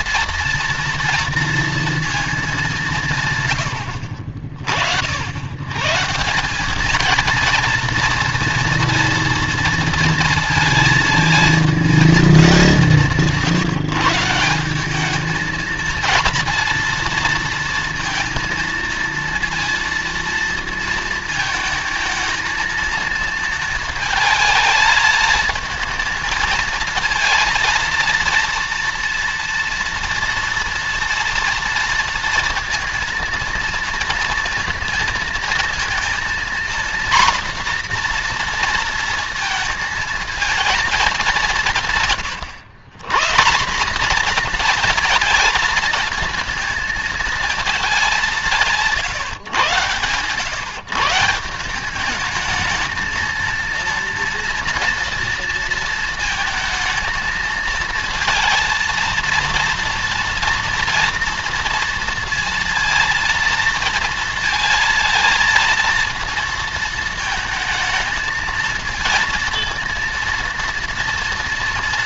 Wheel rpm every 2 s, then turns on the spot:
240, 190, 70, 200, 230, 220, 180, 190, 230, 230, 230, 230, 220, 230, 230, 230, 230, 230, 240, 230, 220, 140, 230, 220, 160, 130, 220, 230, 230, 230, 230, 230, 230, 220, 230, 230.
none